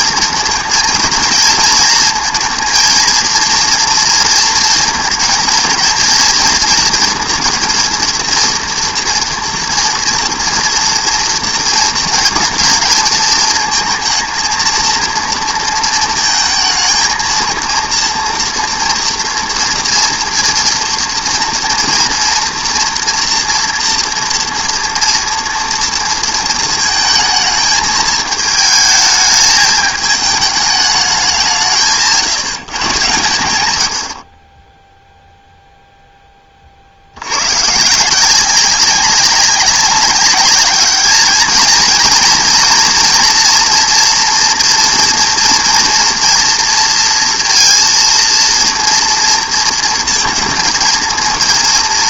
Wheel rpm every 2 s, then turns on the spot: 220, 230, 230, 230, 240, 230, 220, 230, 220, 230, 230, 230, 230, 220, 220, 210, 140, 30, 30, 190, 210, 230, 230, 230, 230, 220.
none